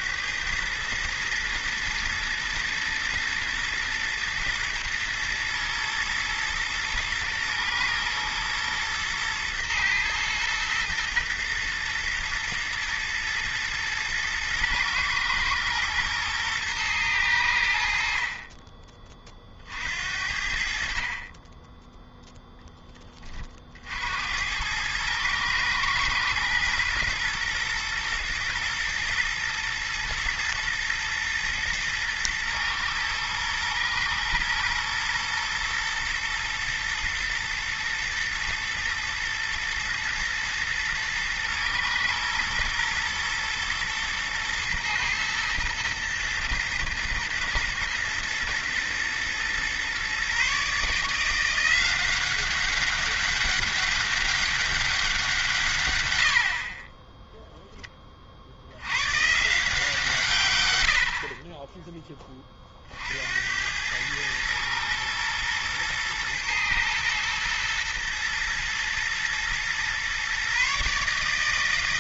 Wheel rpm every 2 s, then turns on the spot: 110, 110, 120, 110, 120, 110, 110, 110, 110, 30, 50, 10, 100, 120, 110, 110, 110, 120, 120, 110, 110, 110, 110, 120, 120, 150, 190, 190, 30, 90, 90, 50, 110, 120, 110, 140.
none